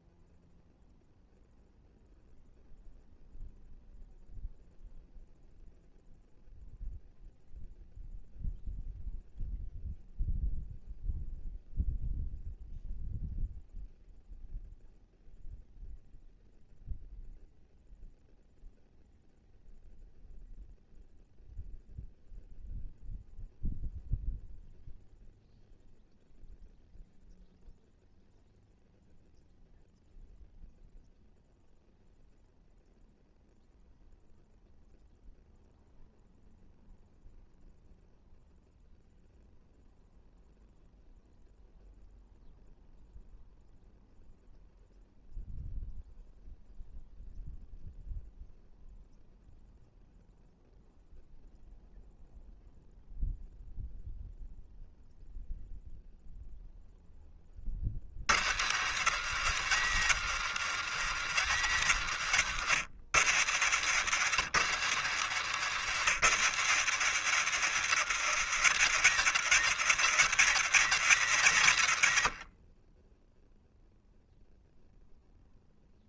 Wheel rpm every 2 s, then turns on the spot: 0, 0, 0, 0, 0, 0, 0, 0, 0, 0, 0, 0, 0, 0, 0, 0, 0, 0, 0, 0, 0, 0, 0, 0, 0, 0, 0, 0, 10, 90, 90, 80, 90, 90, 90, 90, 10, 0.
none